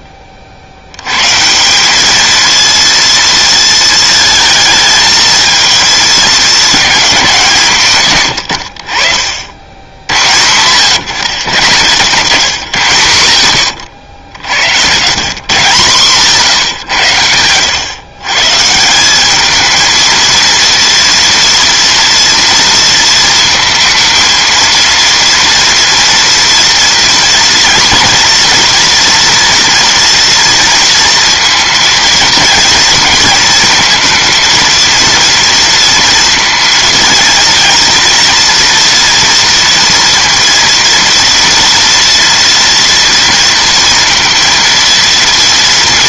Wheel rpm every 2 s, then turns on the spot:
70, 230, 220, 220, 90, 110, 130, 80, 150, 160, 230, 230, 230, 230, 230, 230, 230, 230, 230, 230, 230, 230, 230.
10-12